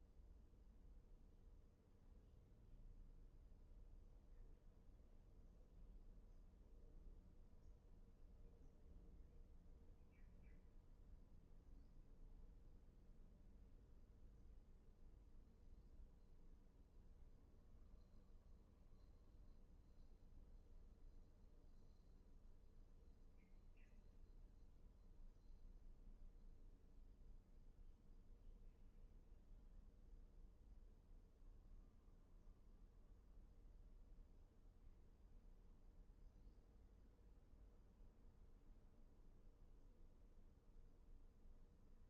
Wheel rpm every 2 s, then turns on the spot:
0, 0, 0, 0, 0, 0, 0, 0, 0, 0, 0, 0, 0, 0, 0, 0, 0, 0, 0, 0, 0.
none